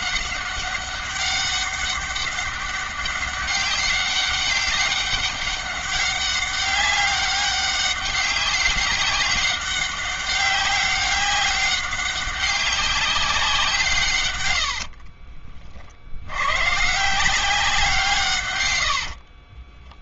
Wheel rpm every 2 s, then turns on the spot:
190, 200, 200, 200, 190, 200, 200, 50, 150, 80.
14-16 18-20